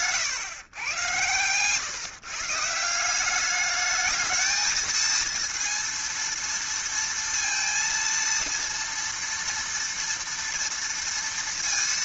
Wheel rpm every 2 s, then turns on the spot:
120, 170, 220, 230, 230, 230.
none